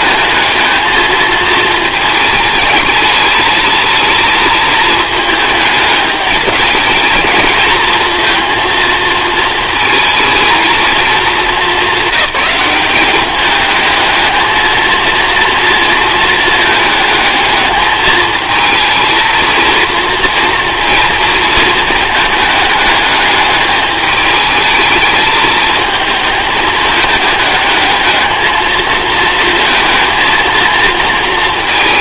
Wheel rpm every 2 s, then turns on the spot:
220, 210, 220, 210, 230, 220, 200, 220, 220, 230, 230, 210, 220, 220, 230, 230.
none